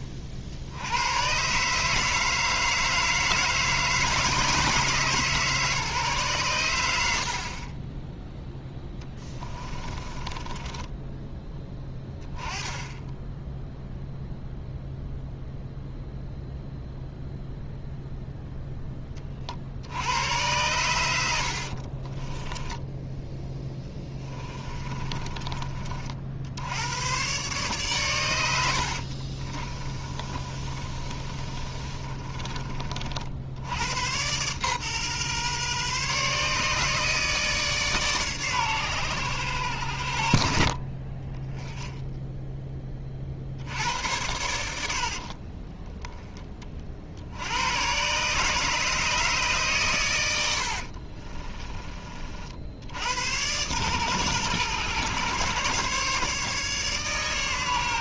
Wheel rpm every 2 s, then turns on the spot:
50, 160, 150, 100, 0, 20, 10, 0, 0, 0, 100, 10, 30, 100, 80, 30, 40, 130, 150, 130, 40, 20, 70, 30, 150, 70, 70, 120, 140.
10-12 24-26 28-32 50-52